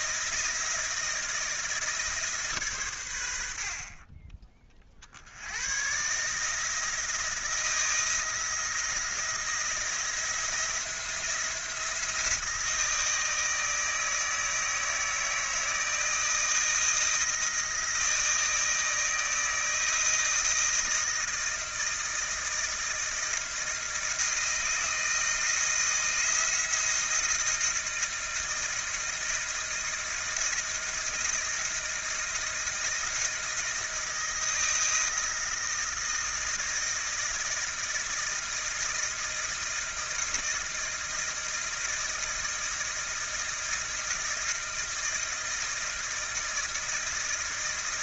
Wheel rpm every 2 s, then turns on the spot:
160, 110, 50, 170, 170, 170, 160, 160, 160, 160, 160, 160, 160, 160, 160, 160, 170, 160, 160, 160, 160, 160, 160, 160.
none